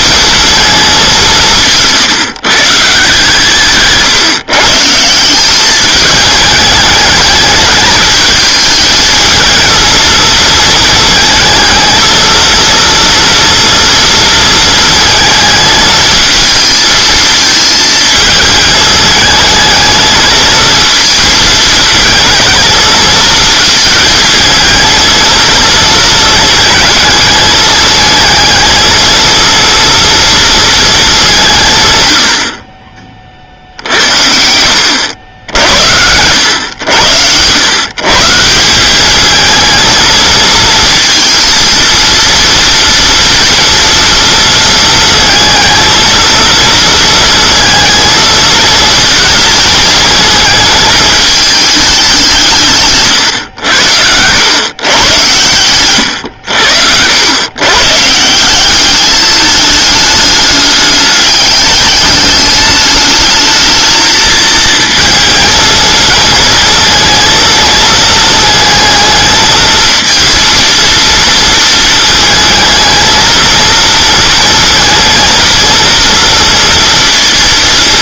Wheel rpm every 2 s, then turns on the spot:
220, 140, 140, 210, 220, 220, 230, 220, 220, 220, 230, 230, 220, 220, 220, 230, 50, 80, 90, 180, 230, 230, 230, 220, 220, 220, 140, 120, 80, 190, 210, 210, 220, 230, 220, 230, 220, 230, 230.
none